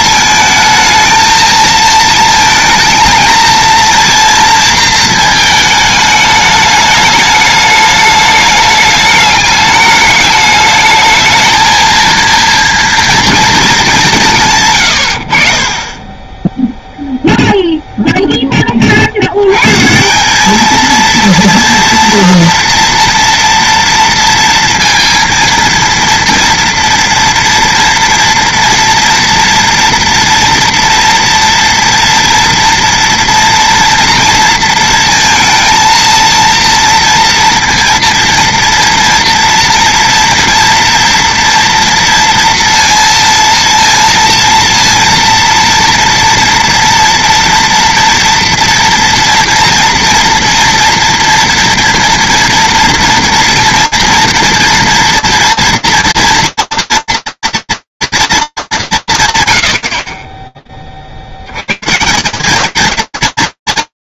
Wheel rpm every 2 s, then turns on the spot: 220, 220, 220, 210, 210, 210, 230, 120, 0, 50, 220, 230, 230, 230, 230, 230, 230, 230, 230, 230, 230, 230, 230, 240, 230, 230, 230, 230, 230, 220, 30, 190.
none